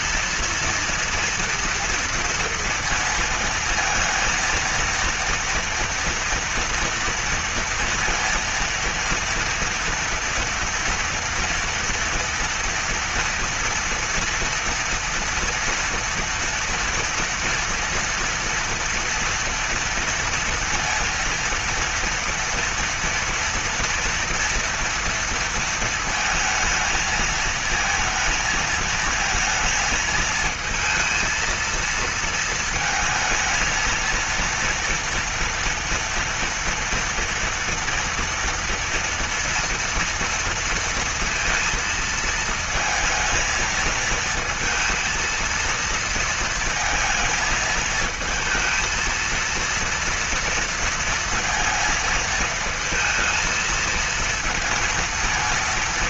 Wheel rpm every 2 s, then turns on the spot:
230, 230, 230, 230, 230, 230, 230, 230, 230, 230, 230, 230, 230, 230, 220, 220, 220, 230, 230, 230, 230, 220, 220, 230, 220, 230, 230, 230.
none